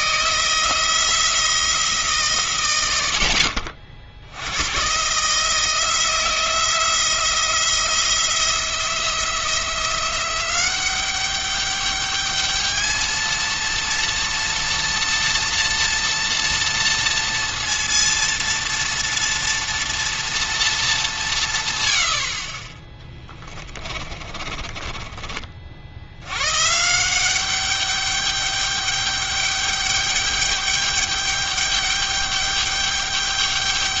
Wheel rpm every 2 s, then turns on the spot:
160, 110, 110, 170, 170, 190, 220, 230, 230, 230, 220, 30, 30, 130, 200, 210, 210.
22-26